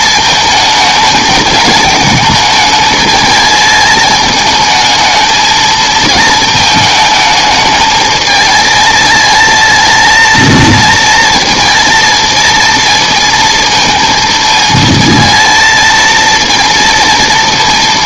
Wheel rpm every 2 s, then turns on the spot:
220, 220, 220, 220, 220, 230, 230, 230, 230.
none